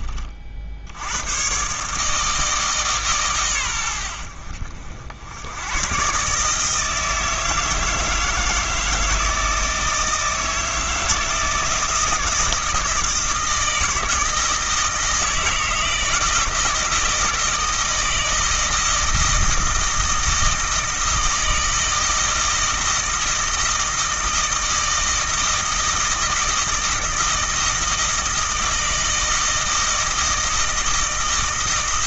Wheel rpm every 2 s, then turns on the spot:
60, 160, 70, 150, 160, 160, 160, 160, 160, 160, 160, 160, 160, 160, 160, 160.
none